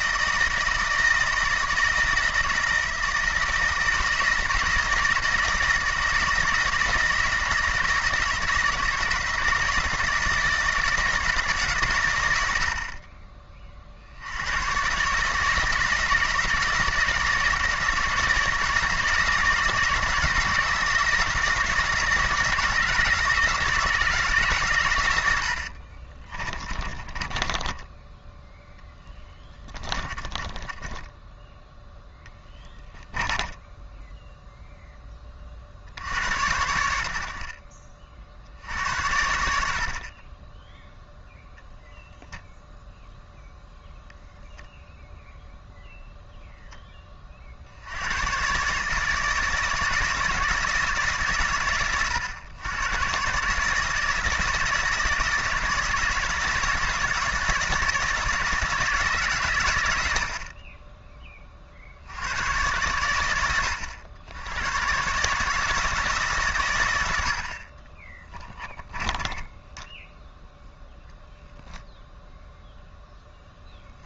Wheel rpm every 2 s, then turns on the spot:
160, 160, 160, 160, 160, 160, 80, 110, 160, 160, 160, 170, 130, 30, 10, 20, 10, 0, 80, 70, 10, 0, 0, 10, 140, 160, 110, 160, 160, 160, 30, 90, 100, 120, 20, 0, 0.
26-28 30-34 68-70